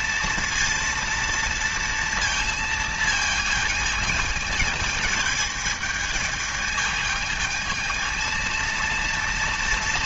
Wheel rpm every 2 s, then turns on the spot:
230, 230, 220, 220, 230.
none